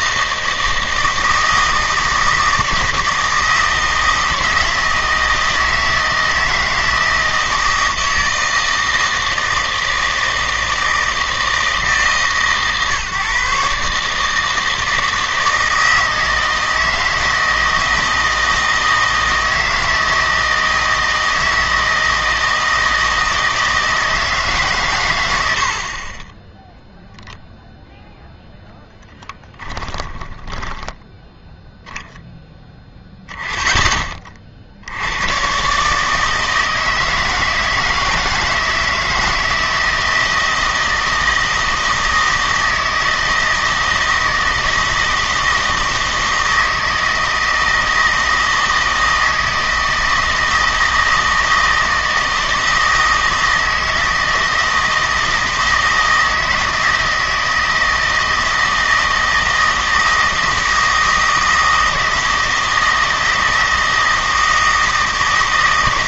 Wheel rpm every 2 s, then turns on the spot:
160, 160, 160, 160, 160, 160, 140, 160, 160, 160, 160, 160, 140, 0, 0, 10, 10, 60, 160, 160, 160, 160, 160, 160, 160, 160, 160, 160, 160, 160, 160, 160, 160.
30-32